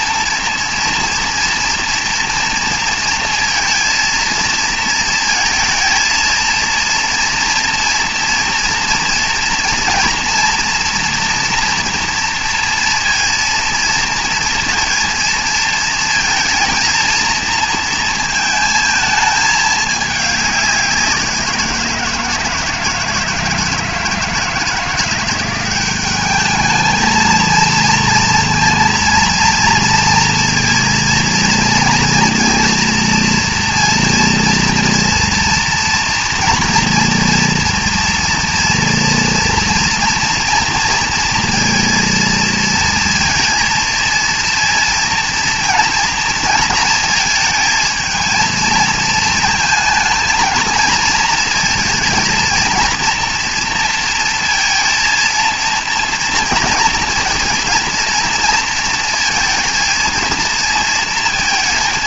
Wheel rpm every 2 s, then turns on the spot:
230, 230, 230, 230, 230, 230, 230, 230, 230, 220, 190, 160, 160, 210, 230, 230, 230, 230, 230, 230, 230, 230, 230, 230, 220, 230, 230, 230, 240, 230, 230.
none